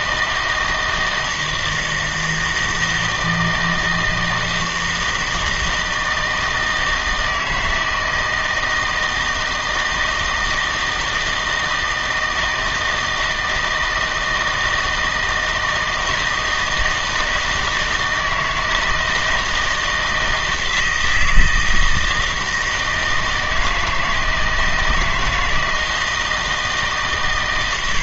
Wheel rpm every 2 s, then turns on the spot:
160, 160, 160, 160, 160, 160, 160, 160, 160, 160, 160, 160, 160, 150.
none